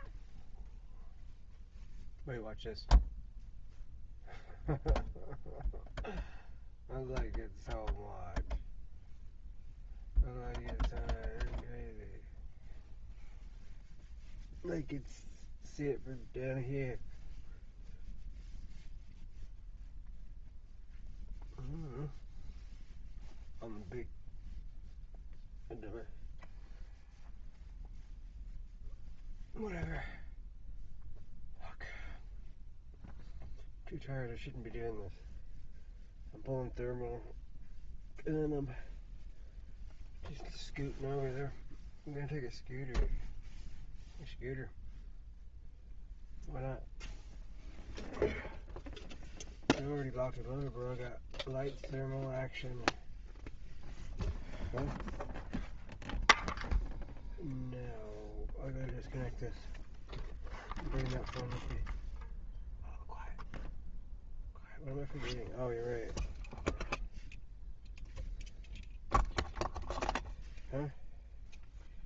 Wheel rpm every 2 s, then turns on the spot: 0, 0, 0, 0, 0, 0, 0, 0, 0, 0, 0, 0, 0, 0, 0, 0, 0, 0, 0, 0, 0, 0, 0, 0, 0, 0, 0, 0, 0, 0, 0, 0, 0, 0, 0, 0.
none